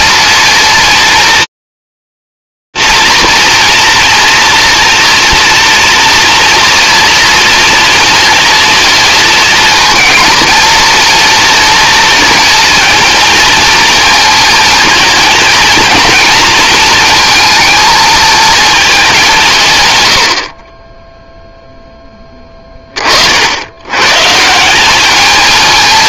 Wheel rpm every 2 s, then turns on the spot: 230, 230, 240, 230, 230, 220, 230, 220, 220, 230, 120, 10, 130.
none